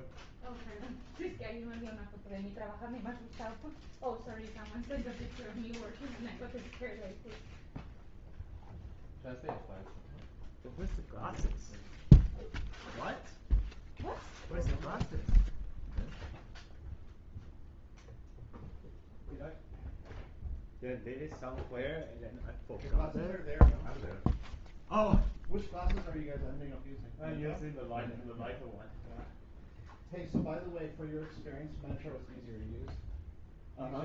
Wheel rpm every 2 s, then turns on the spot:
0, 0, 0, 0, 0, 0, 0, 0, 0, 0, 0, 0, 0, 0, 0, 0, 0.
none